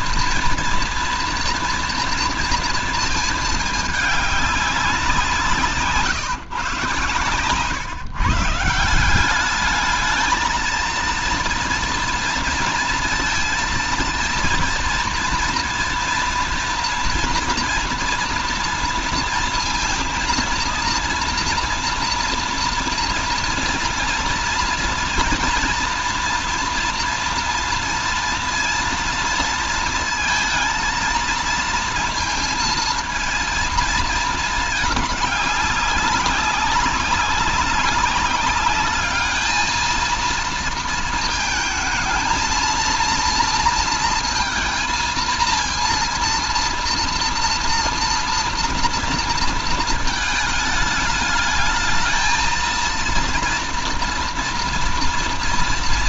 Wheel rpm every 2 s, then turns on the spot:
240, 230, 190, 130, 160, 230, 230, 230, 230, 230, 230, 230, 230, 230, 230, 230, 230, 210, 190, 200, 230, 230, 230, 230, 230, 220, 220, 230.
none